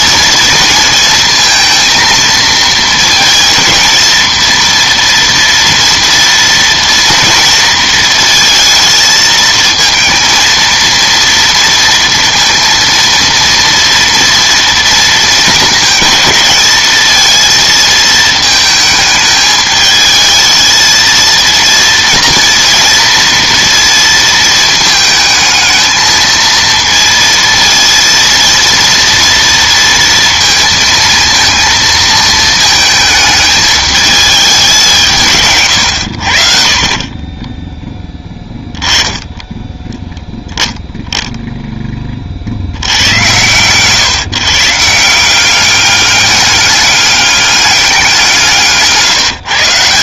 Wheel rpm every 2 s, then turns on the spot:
230, 220, 230, 230, 220, 230, 230, 240, 220, 220, 220, 230, 220, 230, 230, 230, 220, 200, 50, 20, 10, 70, 150, 200, 160.
none